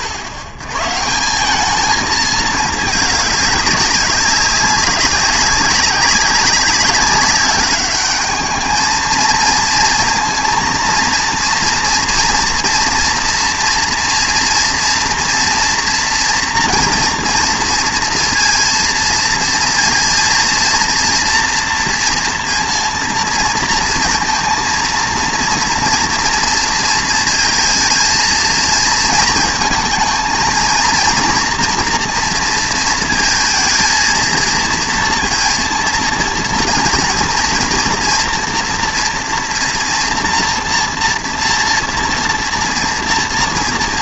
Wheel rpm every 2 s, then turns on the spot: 100, 210, 190, 190, 220, 230, 230, 230, 230, 230, 230, 230, 230, 230, 230, 230, 230, 230, 240, 240, 240, 230.
none